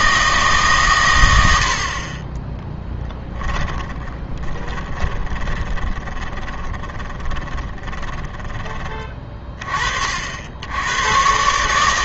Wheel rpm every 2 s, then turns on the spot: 140, 10, 20, 20, 20, 80.
4-8